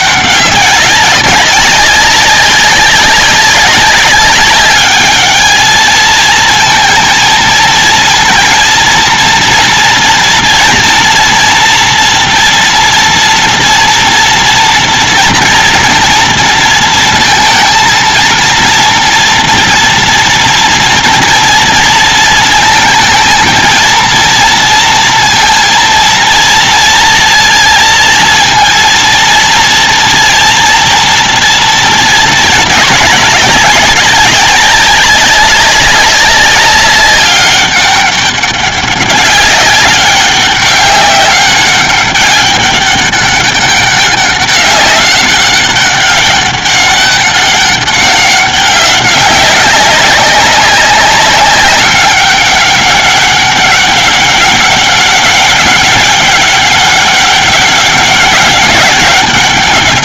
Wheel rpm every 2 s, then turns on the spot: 190, 190, 200, 220, 230, 240, 230, 230, 240, 230, 240, 230, 230, 230, 230, 230, 220, 200, 200, 200, 190, 200, 200, 200, 200, 200, 190, 200, 200, 200.
none